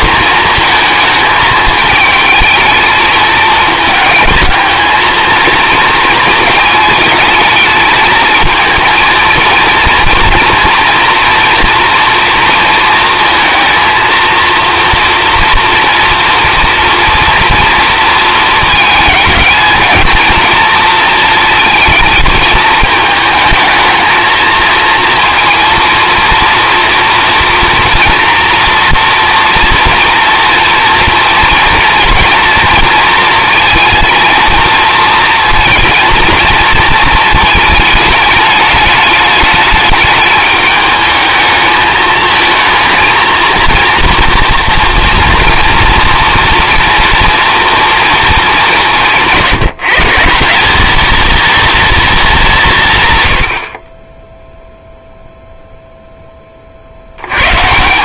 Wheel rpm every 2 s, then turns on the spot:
220, 220, 220, 220, 230, 230, 230, 230, 230, 220, 220, 220, 230, 230, 230, 230, 230, 230, 220, 210, 210, 230, 230, 230, 170, 220, 140, 0, 70.
none